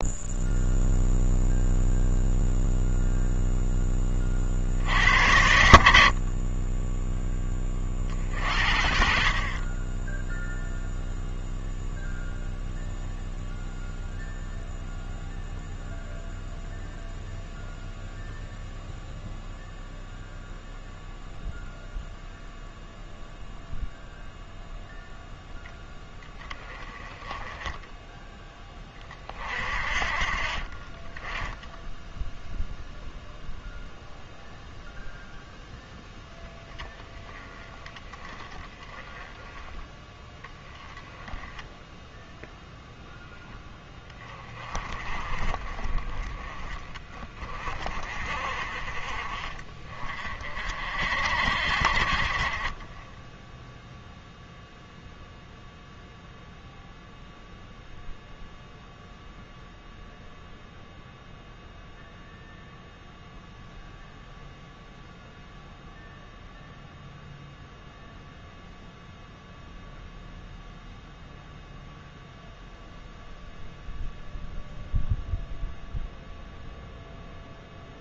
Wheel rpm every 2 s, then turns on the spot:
0, 0, 70, 10, 50, 0, 0, 0, 0, 0, 0, 0, 0, 20, 30, 20, 0, 0, 20, 20, 10, 0, 20, 20, 30, 50, 20, 0, 0, 0, 0, 0, 0, 0, 0, 0, 0, 0, 0.
none